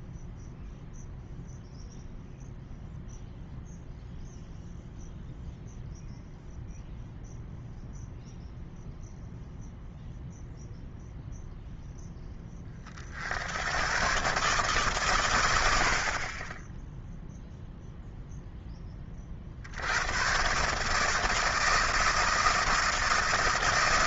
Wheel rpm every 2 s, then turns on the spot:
0, 0, 0, 0, 0, 0, 30, 130, 0, 20, 150, 160.
none